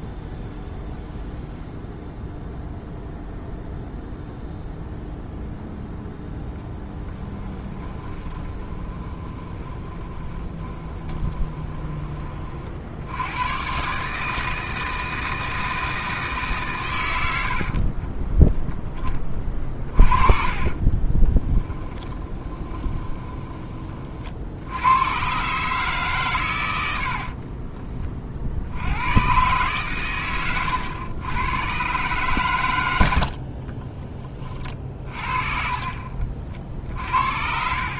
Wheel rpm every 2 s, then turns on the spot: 0, 0, 0, 10, 30, 20, 60, 160, 120, 10, 30, 20, 100, 90, 90, 100, 90, 40, 50.
6-12 20-24 26-28